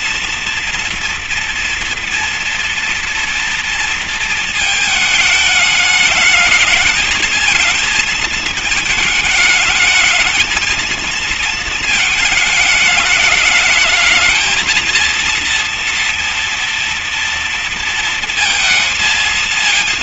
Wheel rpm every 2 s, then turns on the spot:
230, 240, 220, 210, 220, 220, 220, 220, 230, 230.
none